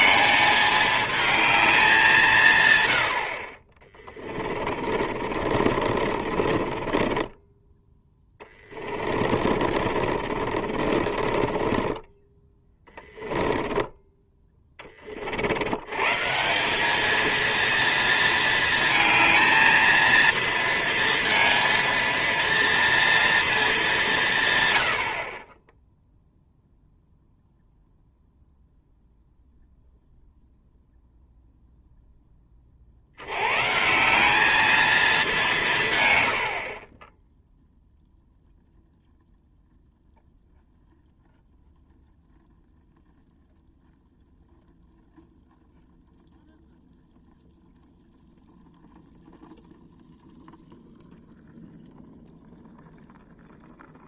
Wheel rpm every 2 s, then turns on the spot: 220, 100, 40, 20, 20, 40, 20, 30, 200, 220, 230, 230, 110, 0, 0, 0, 50, 220, 30, 0, 0, 0, 0, 0, 0, 0, 0.
4-14